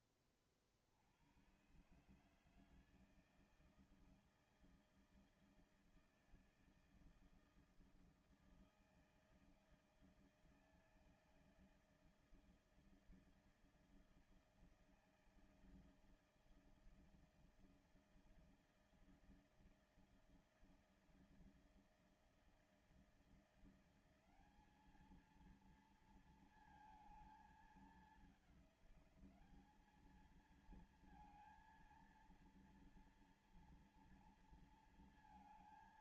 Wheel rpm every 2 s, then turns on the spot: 60, 160, 160, 160, 160, 160, 160, 160, 160, 160, 160, 160, 210, 220, 200, 230, 230, 230.
none